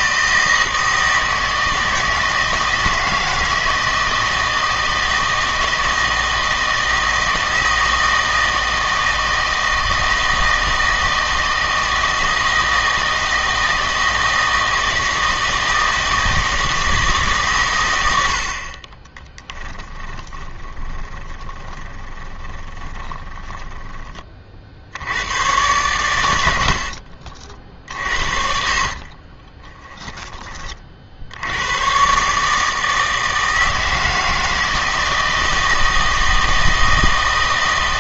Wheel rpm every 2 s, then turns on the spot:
160, 160, 160, 160, 160, 160, 160, 160, 160, 40, 20, 10, 60, 70, 50, 40, 160, 160, 160.
20-24 26-30